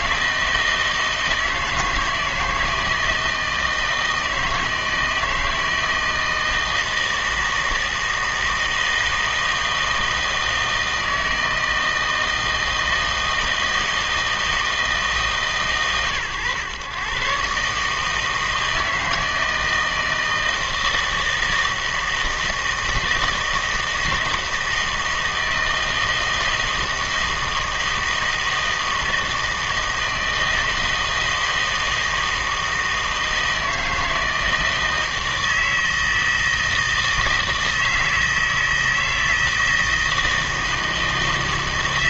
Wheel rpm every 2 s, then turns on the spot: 160, 160, 160, 160, 160, 160, 160, 160, 120, 160, 160, 160, 160, 160, 160, 160, 160, 160, 160, 160, 160.
none